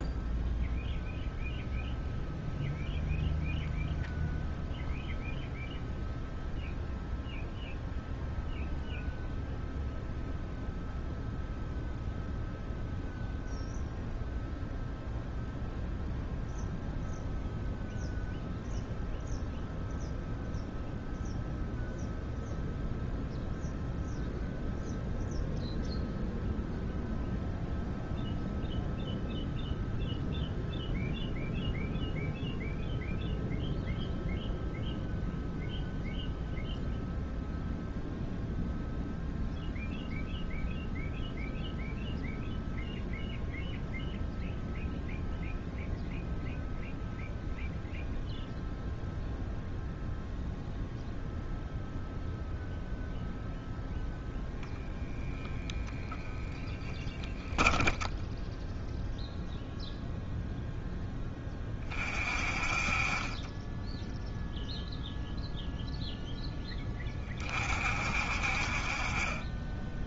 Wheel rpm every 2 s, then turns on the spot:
0, 0, 0, 0, 0, 0, 0, 0, 0, 0, 0, 0, 0, 0, 0, 0, 0, 0, 0, 0, 0, 0, 0, 0, 0, 0, 0, 10, 10, 10, 0, 40, 0, 20, 50.
56-60